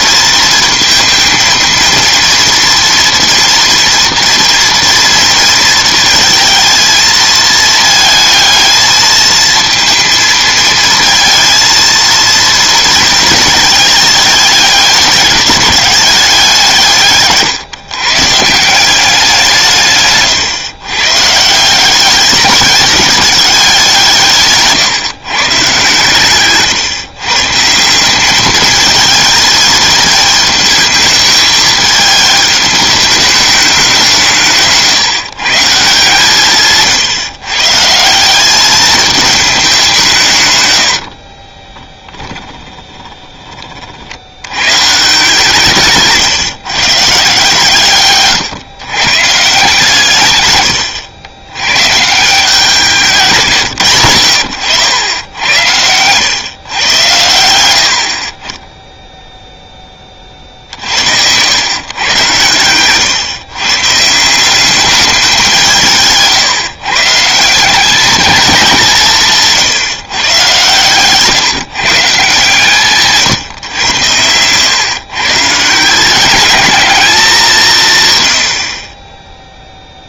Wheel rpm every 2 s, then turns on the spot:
230, 230, 230, 220, 220, 230, 230, 200, 180, 170, 130, 200, 150, 140, 220, 220, 210, 160, 160, 210, 100, 20, 130, 130, 120, 110, 180, 90, 110, 10, 50, 120, 200, 150, 190, 130, 150, 120, 220, 50.
42-44